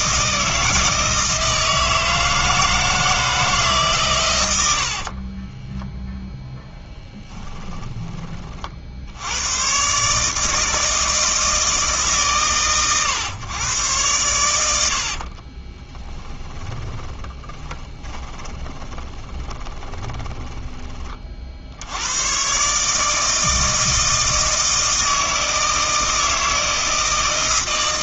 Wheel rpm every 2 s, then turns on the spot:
160, 160, 80, 0, 60, 160, 130, 90, 20, 20, 30, 140, 160, 160.
14-22